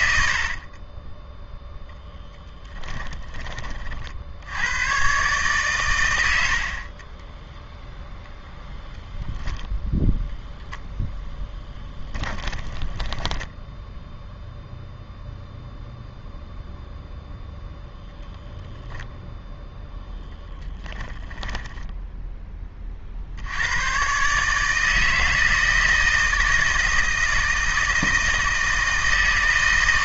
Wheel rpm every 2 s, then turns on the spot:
30, 10, 110, 40, 0, 0, 10, 0, 0, 0, 10, 40, 160, 160, 160.
0-2 12-14 20-22